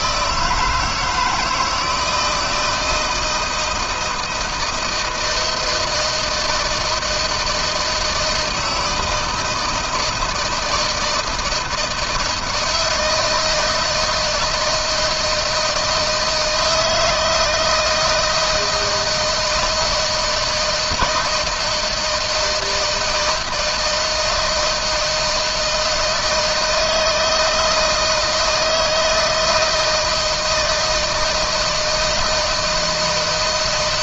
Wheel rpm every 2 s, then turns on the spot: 160, 160, 160, 160, 160, 160, 160, 160, 170, 160, 160, 160, 160, 160, 160, 160, 160.
none